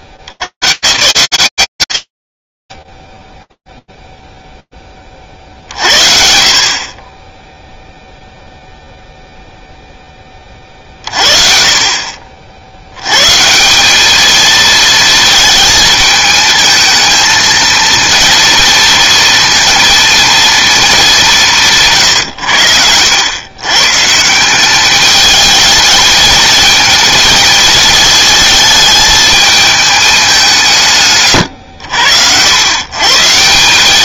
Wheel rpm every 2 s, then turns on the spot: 90, 30, 0, 50, 0, 40, 90, 220, 220, 230, 210, 100, 210, 230, 220, 140, 140.
none